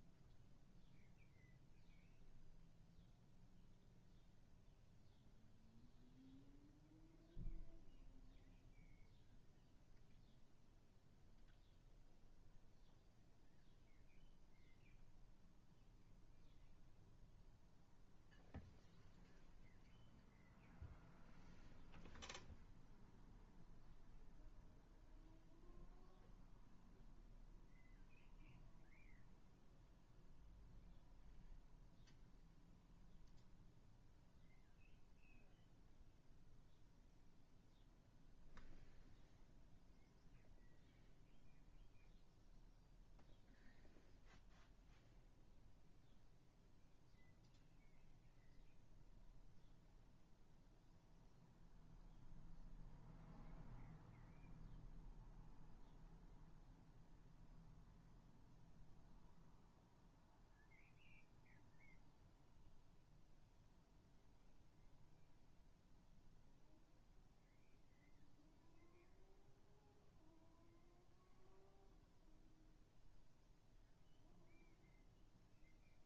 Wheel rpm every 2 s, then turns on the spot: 0, 0, 0, 0, 0, 0, 0, 0, 0, 0, 0, 0, 0, 0, 0, 0, 0, 0, 0, 0, 0, 0, 0, 0, 0, 0, 0, 0, 0, 0, 0, 0, 0, 0, 0, 0, 0, 0.
none